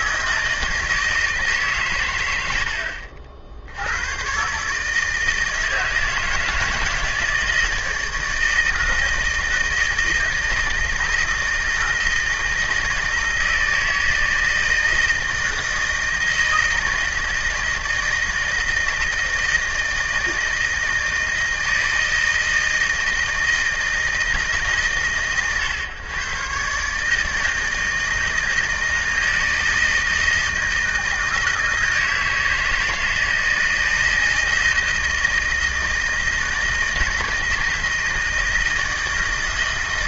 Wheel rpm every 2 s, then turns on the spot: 160, 110, 110, 160, 160, 160, 160, 160, 160, 160, 160, 160, 160, 120, 160, 160, 160, 160, 160, 160.
none